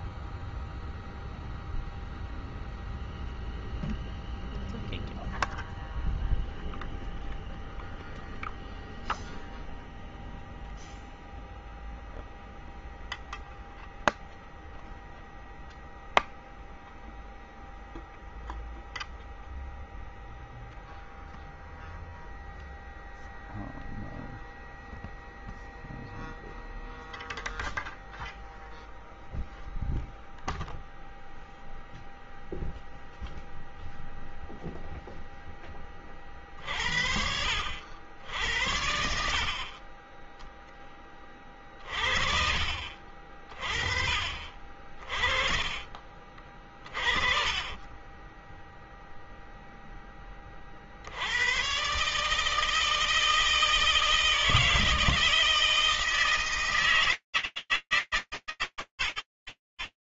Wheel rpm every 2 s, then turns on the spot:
0, 0, 0, 0, 0, 0, 0, 0, 0, 0, 0, 0, 0, 0, 0, 0, 0, 0, 40, 80, 10, 40, 40, 40, 10, 30, 150, 160, 150, 10.
46-50